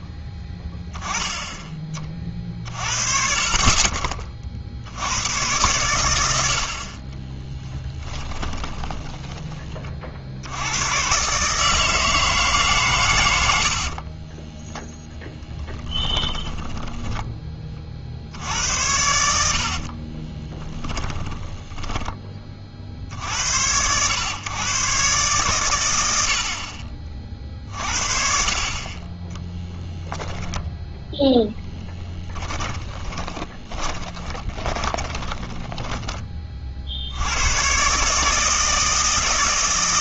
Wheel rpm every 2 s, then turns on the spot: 10, 40, 60, 70, 20, 100, 150, 10, 20, 80, 10, 40, 130, 50, 40, 0, 10, 10, 40, 160.
8-10 14-18 20-22 32-36